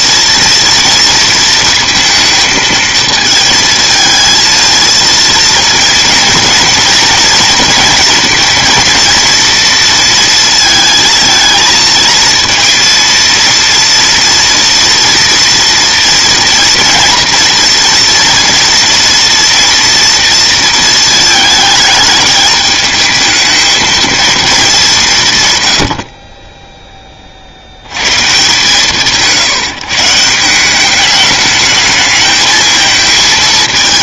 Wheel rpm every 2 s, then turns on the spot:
230, 230, 230, 230, 230, 220, 230, 230, 230, 230, 230, 210, 220, 20, 140, 180, 220.
none